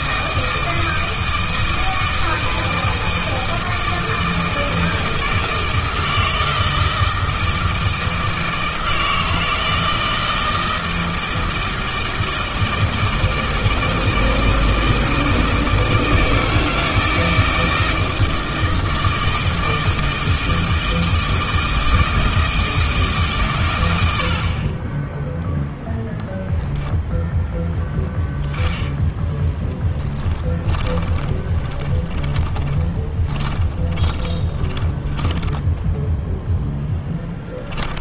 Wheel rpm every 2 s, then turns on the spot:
160, 160, 160, 160, 160, 160, 160, 160, 160, 160, 160, 160, 20, 0, 10, 20, 20, 10, 0.
30-36